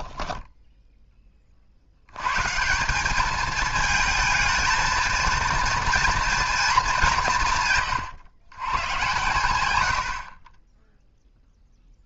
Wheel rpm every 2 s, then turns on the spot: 0, 160, 220, 210, 120, 20.
none